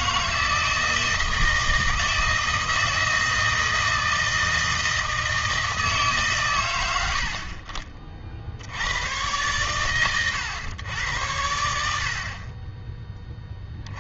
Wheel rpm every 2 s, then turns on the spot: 160, 160, 160, 110, 70, 120, 30.
none